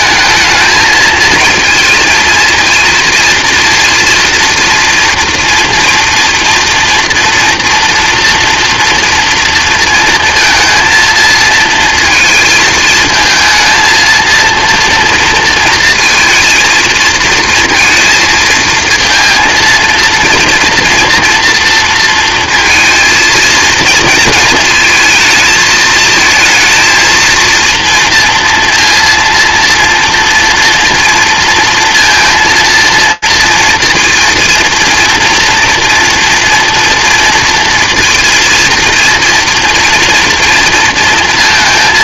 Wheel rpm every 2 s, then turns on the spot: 220, 230, 230, 230, 230, 220, 220, 230, 230, 230, 230, 230, 230, 230, 230, 240, 230, 230, 230, 230, 230.
none